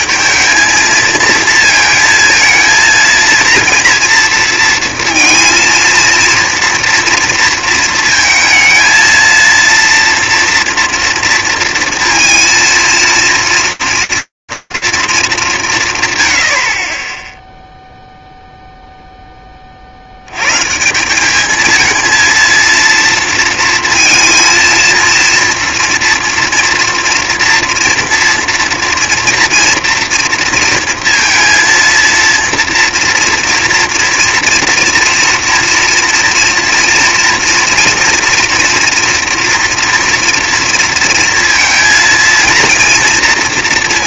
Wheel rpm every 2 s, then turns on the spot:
230, 230, 230, 230, 230, 230, 230, 180, 0, 10, 200, 230, 230, 230, 230, 230, 230, 230, 230, 230, 230, 230.
none